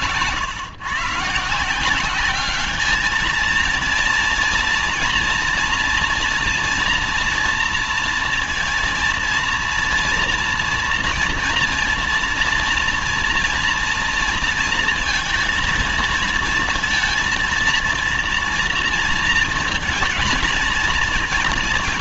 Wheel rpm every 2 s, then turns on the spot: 120, 200, 240, 230, 230, 230, 230, 230, 230, 230, 230.
none